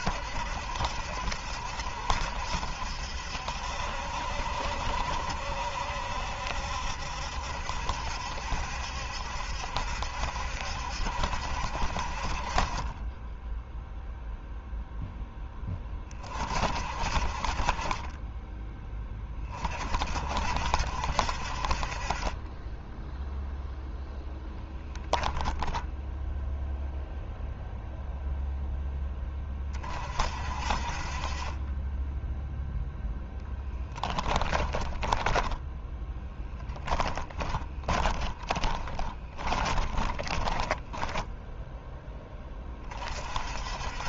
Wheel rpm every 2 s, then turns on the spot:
70, 70, 60, 70, 70, 70, 20, 0, 40, 20, 60, 10, 10, 0, 10, 40, 0, 20, 10, 20, 10, 30.
24-26 34-42